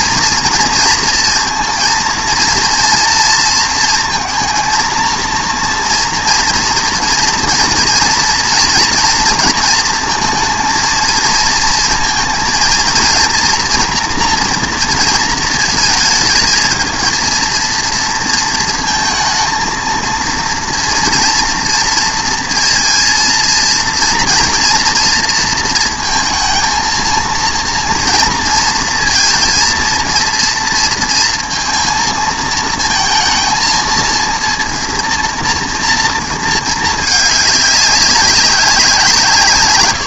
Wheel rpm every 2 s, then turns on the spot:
230, 230, 230, 230, 230, 230, 230, 230, 230, 230, 230, 230, 240, 230, 230, 230, 230, 240, 220, 180.
none